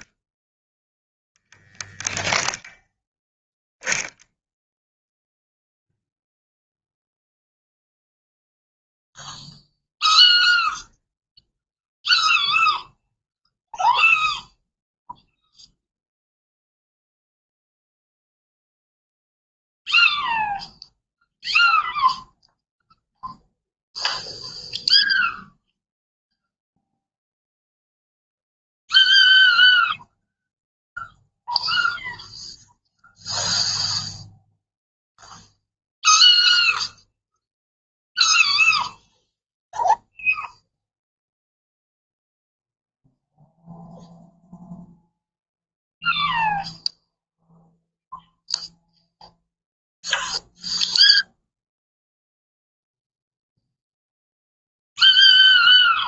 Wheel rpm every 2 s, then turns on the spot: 10, 0, 0, 0, 0, 0, 0, 0, 0, 0, 0, 0, 0, 0, 0, 0, 0, 0, 0, 0, 0, 0, 0, 0, 0, 0, 0, 0.
none